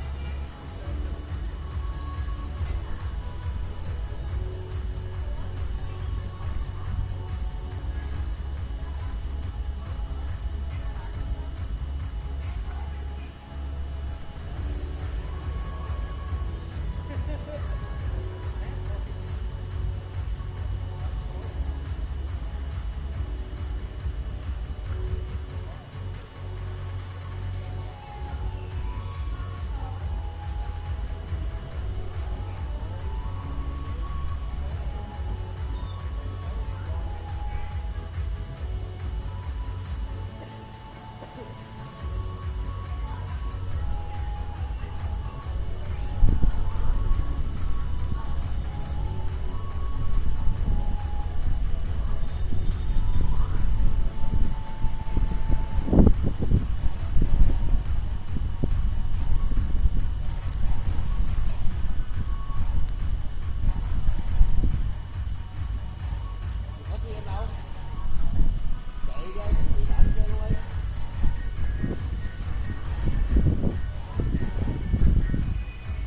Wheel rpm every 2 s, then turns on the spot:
0, 0, 0, 0, 0, 0, 0, 0, 0, 0, 0, 0, 0, 0, 0, 0, 0, 0, 0, 0, 0, 0, 0, 0, 0, 0, 0, 0, 0, 0, 0, 0, 0, 0, 0, 0, 0, 0.
none